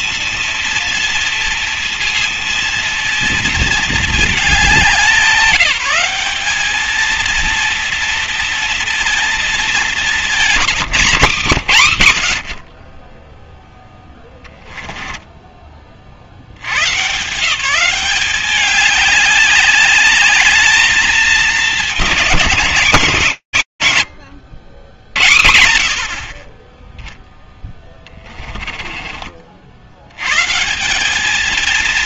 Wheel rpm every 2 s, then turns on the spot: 230, 230, 190, 200, 230, 210, 50, 10, 80, 190, 210, 180, 100, 20, 20, 160.
14-16 28-30